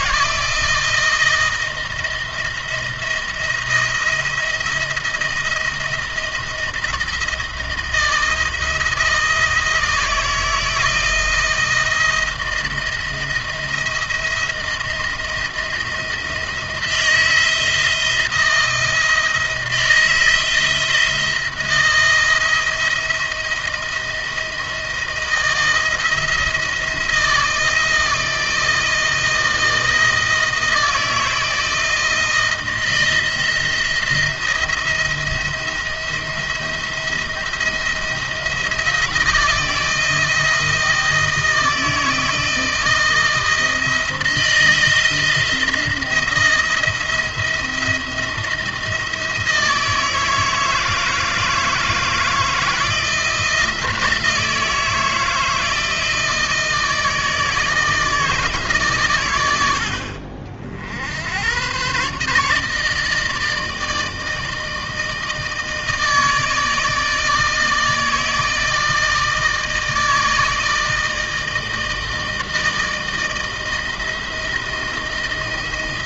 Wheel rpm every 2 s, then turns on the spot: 160, 170, 170, 160, 160, 160, 170, 170, 170, 170, 170, 170, 160, 170, 160, 160, 170, 170, 170, 170, 160, 160, 160, 170, 170, 160, 160, 160, 160, 140, 60, 150, 160, 160, 160, 160, 160, 170.
none